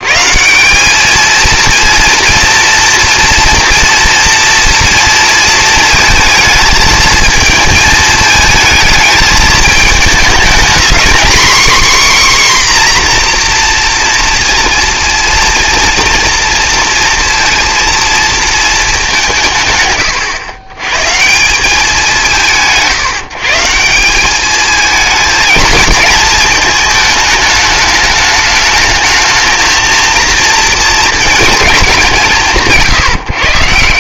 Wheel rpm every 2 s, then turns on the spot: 190, 230, 230, 220, 220, 240, 260, 230, 230, 220, 120, 160, 220, 220, 220, 230, 160.
none